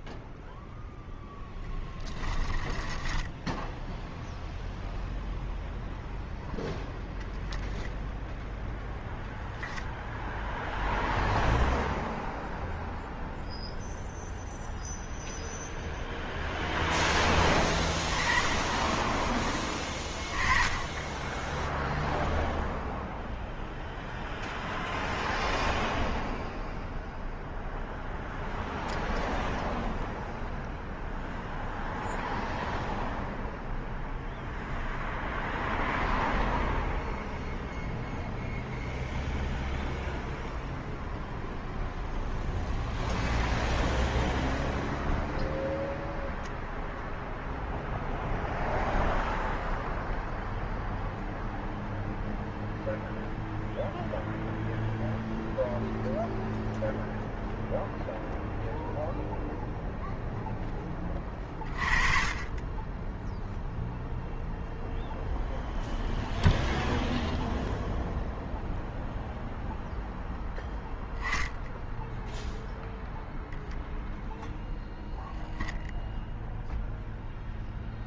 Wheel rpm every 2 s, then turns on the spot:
0, 20, 0, 0, 0, 0, 0, 0, 0, 10, 10, 0, 0, 0, 0, 0, 0, 0, 0, 0, 0, 0, 0, 0, 0, 0, 0, 0, 0, 0, 10, 20, 0, 0, 0, 10, 0, 0, 0.
2-4